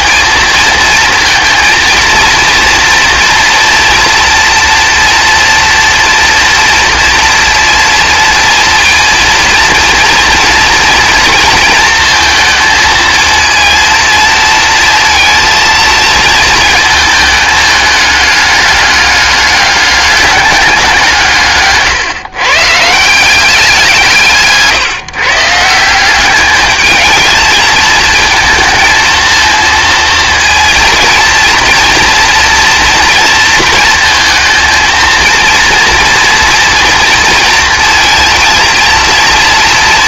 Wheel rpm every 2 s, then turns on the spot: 230, 230, 230, 230, 230, 230, 220, 230, 220, 200, 190, 150, 160, 210, 220, 230, 230, 230, 230, 230.
none